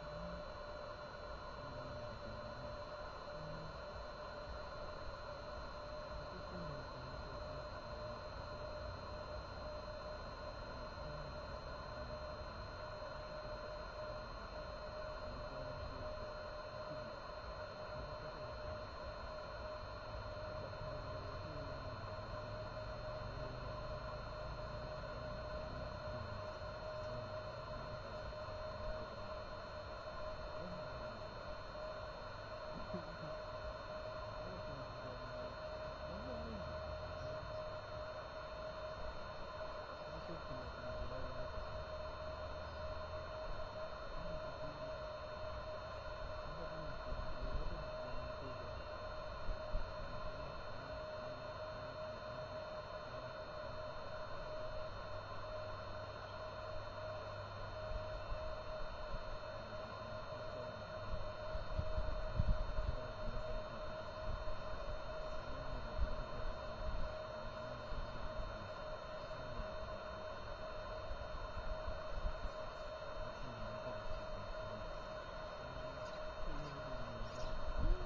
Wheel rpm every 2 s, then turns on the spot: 0, 0, 0, 0, 0, 0, 0, 0, 0, 0, 0, 0, 0, 0, 0, 0, 0, 0, 0, 0, 0, 0, 0, 0, 0, 0, 0, 0, 0, 0, 0, 0, 0, 0, 0, 0, 0, 0, 0.
none